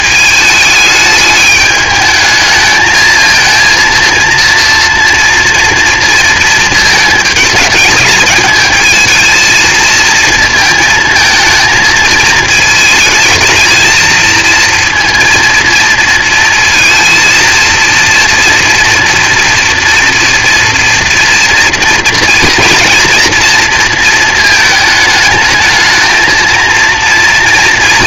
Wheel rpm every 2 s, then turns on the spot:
220, 220, 230, 230, 220, 230, 220, 230, 230, 240, 230, 240, 220, 230.
none